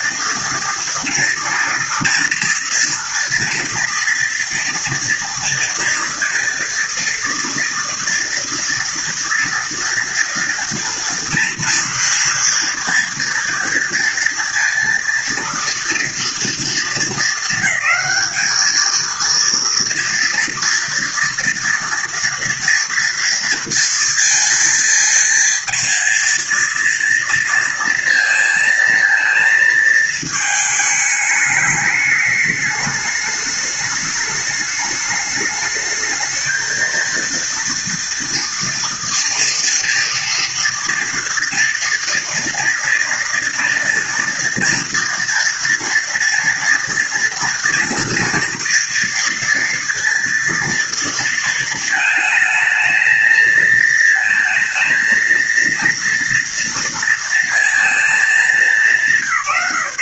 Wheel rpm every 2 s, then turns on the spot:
230, 230, 240, 230, 230, 230, 230, 230, 230, 220, 230, 230, 230, 230, 230, 220, 210, 210, 220, 230, 230, 230, 230, 230, 230, 230, 220, 230, 230, 220.
none